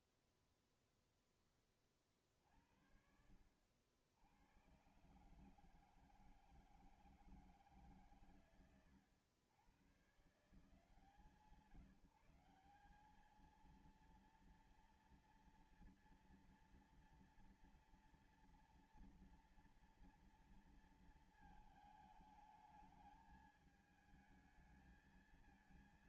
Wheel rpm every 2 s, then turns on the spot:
0, 60, 120, 160, 110, 140, 180, 230, 230, 230, 230, 220, 220.
none